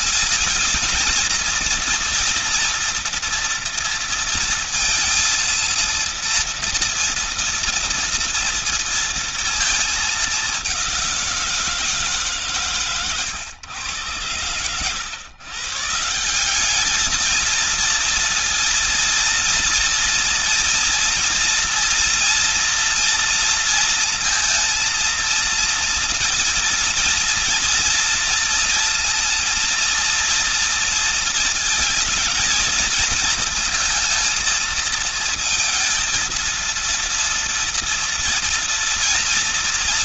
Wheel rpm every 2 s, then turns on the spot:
230, 230, 230, 230, 230, 200, 140, 110, 190, 230, 240, 230, 230, 230, 230, 230, 220, 230, 230, 230.
none